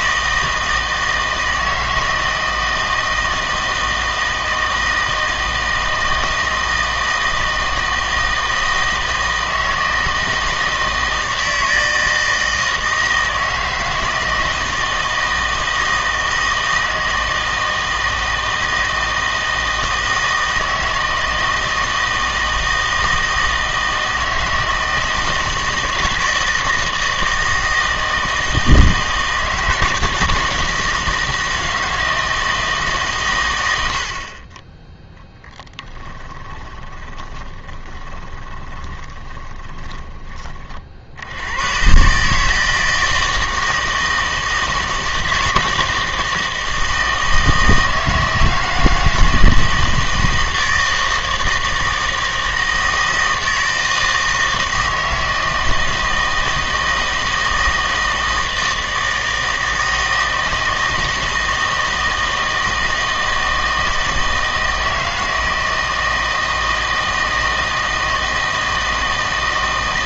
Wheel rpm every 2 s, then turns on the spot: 160, 160, 160, 160, 160, 160, 160, 160, 160, 160, 160, 160, 160, 160, 160, 160, 160, 30, 20, 20, 50, 160, 160, 160, 160, 160, 160, 160, 160, 160, 160, 160, 160, 160, 160.
36-40